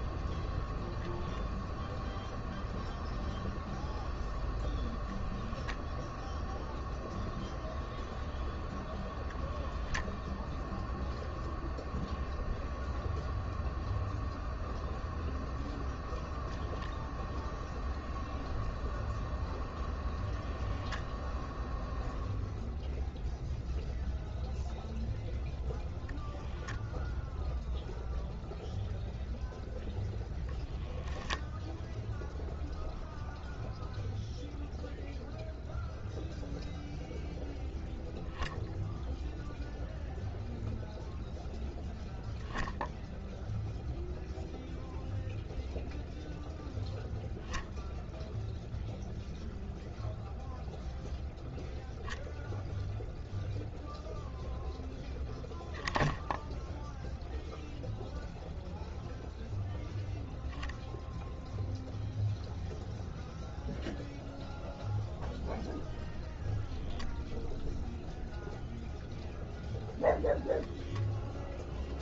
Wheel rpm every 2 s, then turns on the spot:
0, 0, 0, 0, 0, 0, 0, 0, 0, 0, 0, 0, 0, 0, 0, 0, 0, 0, 0, 0, 0, 0, 0, 0, 0, 0, 0, 0, 0, 0, 0, 0, 0, 0, 0, 0.
none